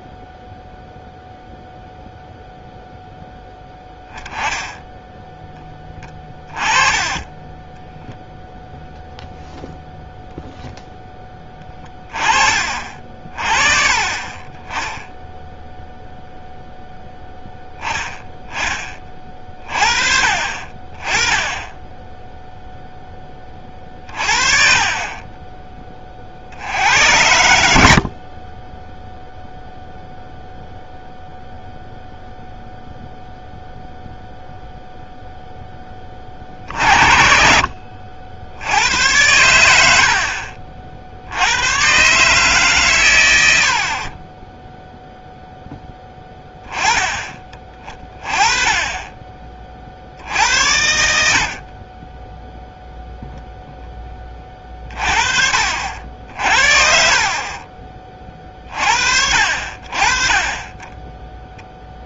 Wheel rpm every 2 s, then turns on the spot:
0, 0, 10, 20, 0, 0, 30, 20, 0, 20, 30, 0, 30, 70, 30, 0, 0, 0, 40, 80, 60, 150, 20, 10, 20, 60, 0, 20, 50, 40, 20.
6-8